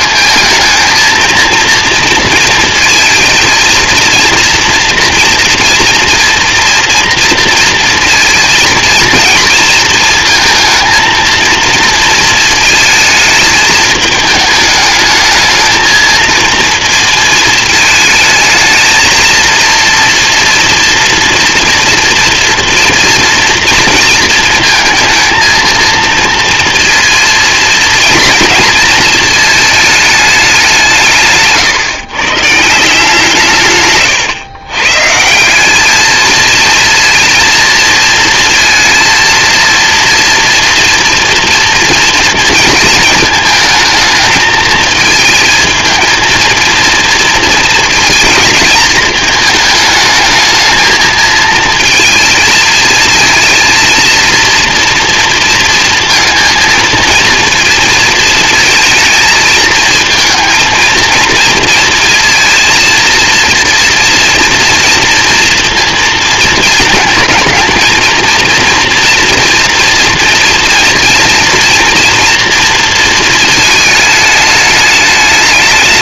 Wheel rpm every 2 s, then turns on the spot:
220, 230, 230, 230, 230, 230, 230, 220, 220, 220, 230, 230, 230, 230, 230, 220, 140, 130, 200, 230, 230, 240, 220, 220, 230, 220, 220, 230, 230, 230, 230, 230, 230, 230, 220, 240, 230, 220.
34-36